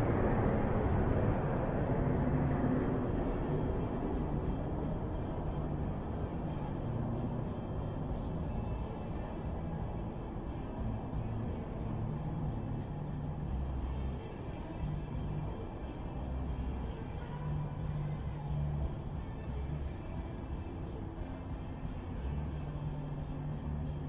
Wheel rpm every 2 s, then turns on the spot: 0, 0, 0, 0, 0, 0, 0, 0, 0, 0, 0, 0.
none